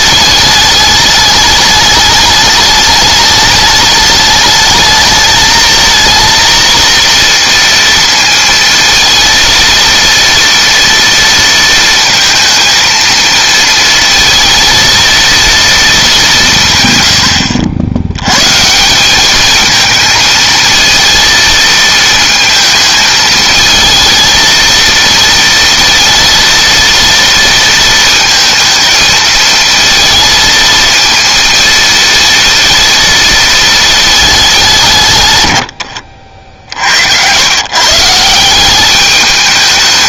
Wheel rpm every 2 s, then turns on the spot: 210, 210, 220, 230, 230, 230, 230, 230, 120, 170, 220, 220, 230, 230, 220, 230, 230, 170, 70, 190.
none